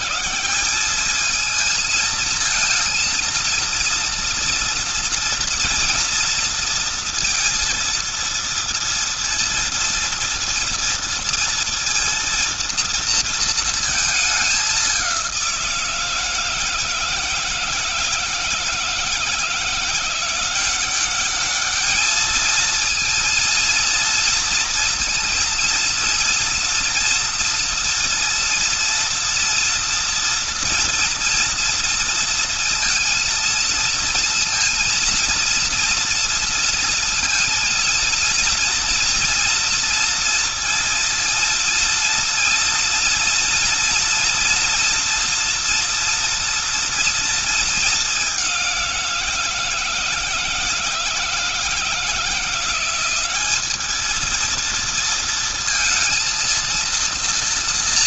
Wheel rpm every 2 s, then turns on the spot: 180, 230, 230, 230, 230, 230, 230, 200, 160, 160, 180, 220, 230, 230, 230, 230, 230, 230, 230, 230, 230, 230, 230, 240, 190, 160, 170, 230, 230.
none